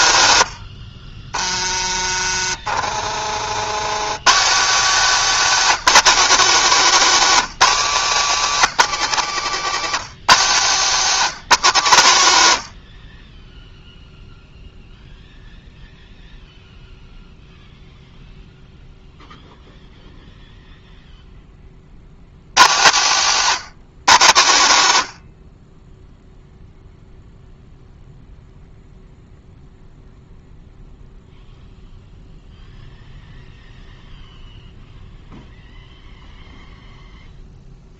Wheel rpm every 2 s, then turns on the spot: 120, 50, 220, 270, 260, 220, 120, 0, 0, 0, 0, 130, 130, 0, 0, 0, 0, 0, 0.
2-4